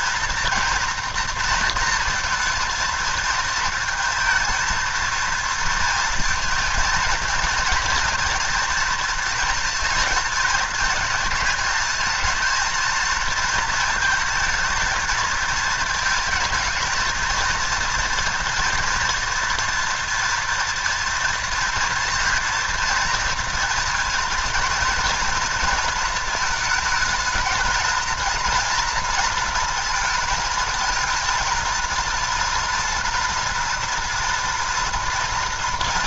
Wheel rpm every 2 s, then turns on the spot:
230, 230, 230, 230, 230, 220, 230, 220, 220, 230, 230, 230, 230, 220, 230, 230, 230, 230.
none